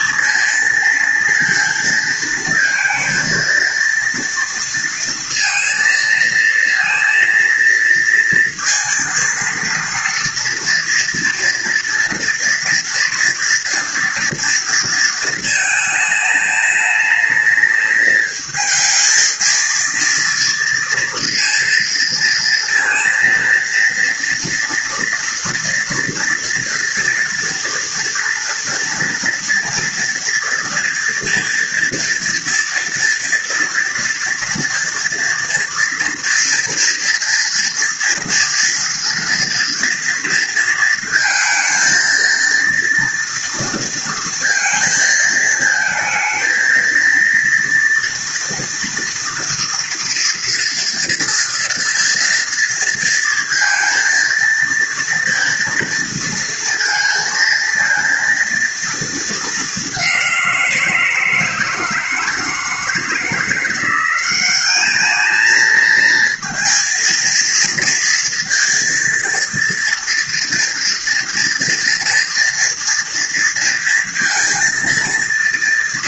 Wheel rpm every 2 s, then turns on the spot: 230, 230, 230, 230, 230, 240, 230, 220, 210, 220, 230, 230, 230, 230, 240, 230, 230, 230, 230, 230, 230, 230, 220, 230, 230, 230, 230, 230, 230, 220, 170, 160, 210, 230, 230, 230, 230, 230.
none